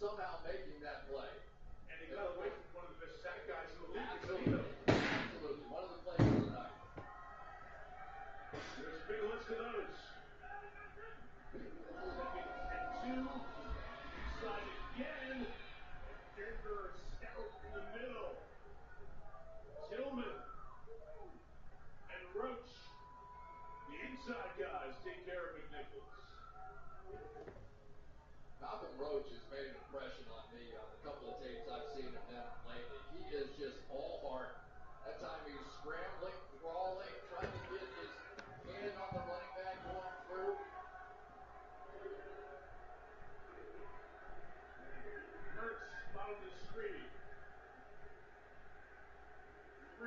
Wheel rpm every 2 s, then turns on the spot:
0, 0, 0, 0, 0, 0, 0, 0, 0, 0, 0, 0, 0, 0, 0, 0, 0, 0, 0, 0, 0, 0, 0, 0, 0.
none